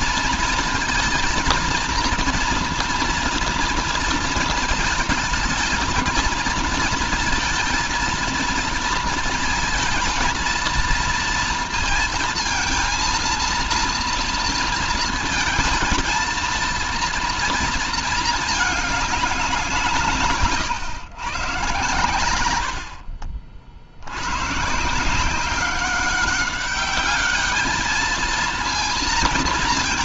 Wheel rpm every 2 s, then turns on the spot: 230, 230, 220, 230, 230, 230, 230, 230, 230, 220, 150, 100, 130, 200, 220.
none